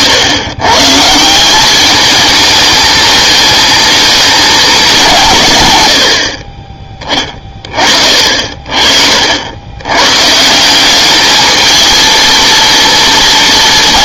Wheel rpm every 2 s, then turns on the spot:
120, 210, 210, 30, 50, 170, 230.
none